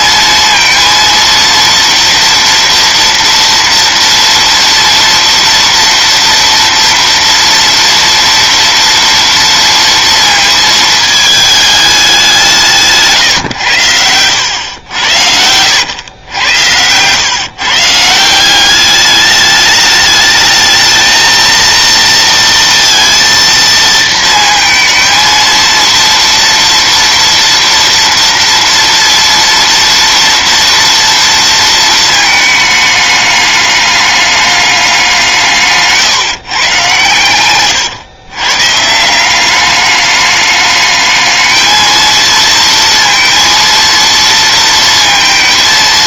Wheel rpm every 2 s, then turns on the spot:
230, 230, 230, 230, 230, 220, 160, 100, 100, 200, 220, 230, 230, 230, 230, 230, 210, 200, 130, 150, 210, 230, 230.
none